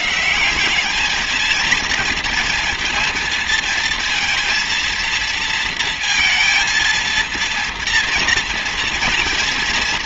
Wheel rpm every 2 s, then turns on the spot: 190, 230, 230, 230, 230.
none